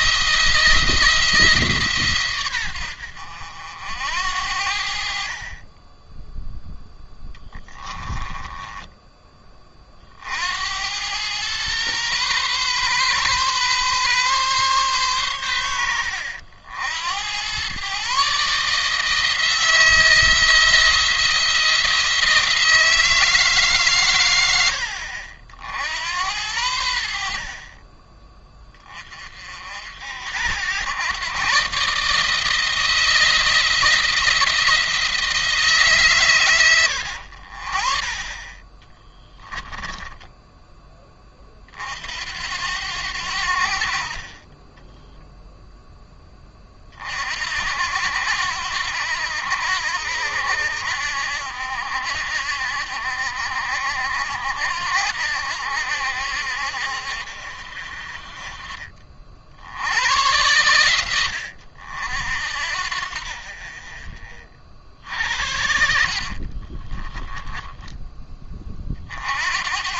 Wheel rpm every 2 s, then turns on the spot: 170, 110, 70, 10, 10, 70, 130, 130, 80, 150, 170, 170, 90, 80, 20, 100, 160, 170, 110, 30, 10, 80, 20, 30, 80, 80, 70, 70, 70, 40, 100, 60, 40, 40, 30.
8-10 38-40 66-68